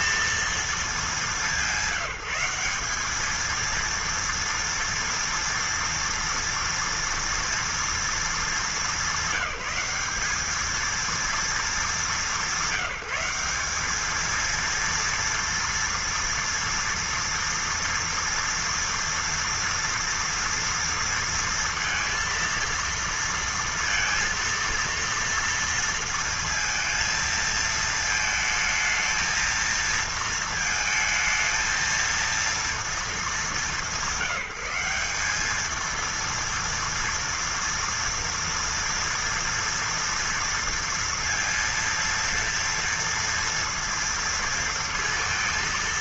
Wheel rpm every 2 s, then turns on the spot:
230, 190, 230, 230, 220, 210, 190, 230, 230, 230, 230, 230, 230, 230, 220, 230, 230, 190, 230, 230, 230, 230, 230.
none